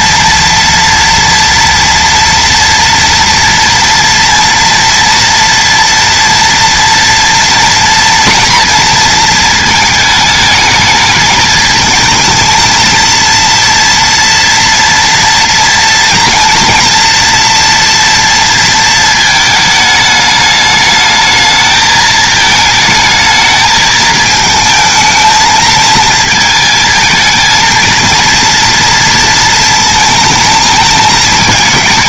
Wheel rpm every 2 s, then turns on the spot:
240, 230, 230, 230, 220, 210, 230, 230, 230, 230, 210, 220, 220, 220, 230, 220.
none